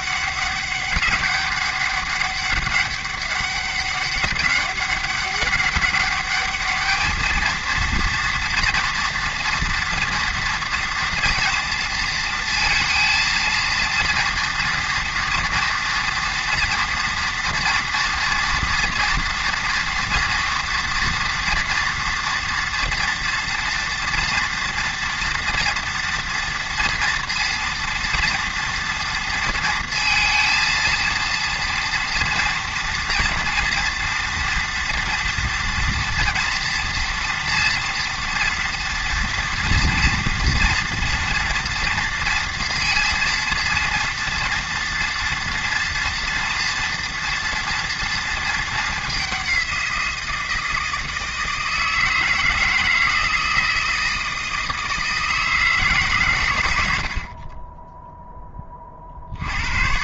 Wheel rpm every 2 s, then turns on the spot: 200, 200, 200, 220, 230, 230, 230, 230, 240, 230, 230, 240, 240, 230, 230, 230, 230, 230, 230, 230, 230, 230, 230, 230, 200, 160, 160, 160, 70, 40.
none